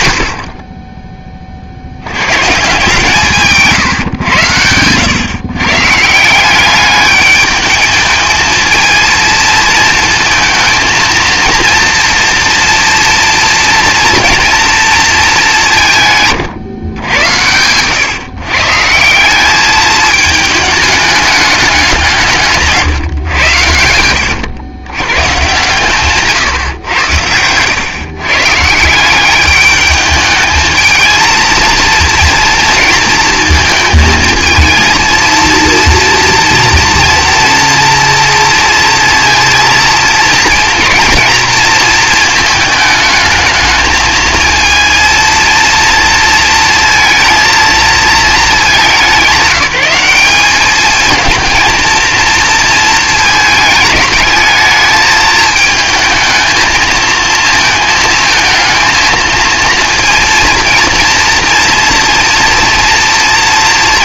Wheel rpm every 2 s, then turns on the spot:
30, 140, 90, 190, 220, 230, 230, 230, 120, 130, 220, 150, 100, 120, 140, 220, 230, 220, 230, 230, 230, 220, 220, 230, 210, 210, 230, 210, 230, 220, 230, 230.
none